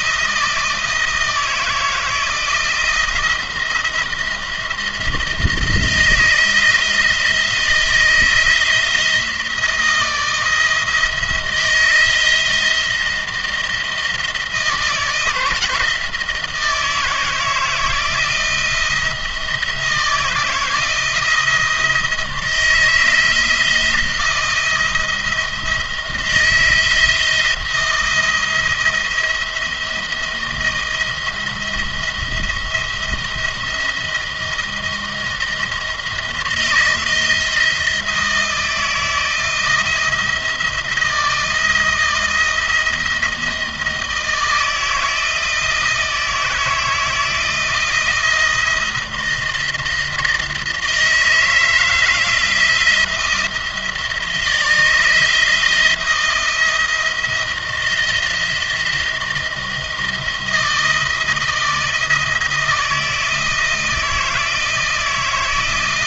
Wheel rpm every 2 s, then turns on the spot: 160, 170, 170, 160, 170, 170, 170, 160, 160, 170, 170, 170, 170, 170, 170, 170, 170, 170, 170, 170, 160, 170, 160, 160, 170, 160, 160, 160, 170, 170, 170, 160, 160.
none